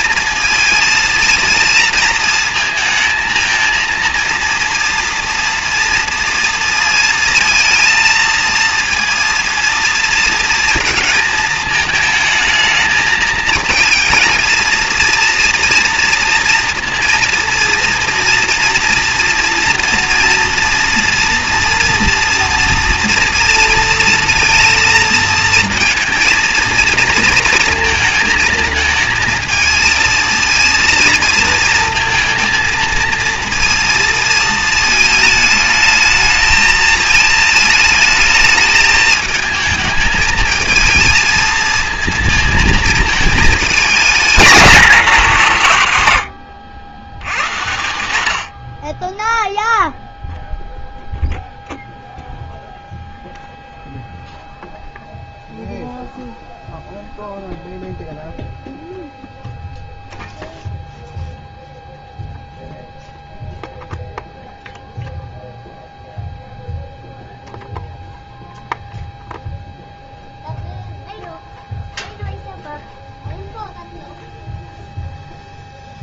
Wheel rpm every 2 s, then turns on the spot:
220, 220, 230, 230, 230, 230, 220, 230, 230, 230, 230, 230, 230, 230, 230, 230, 230, 220, 220, 220, 220, 220, 220, 80, 50, 0, 0, 0, 0, 0, 0, 0, 0, 0, 0, 0, 0, 0.
none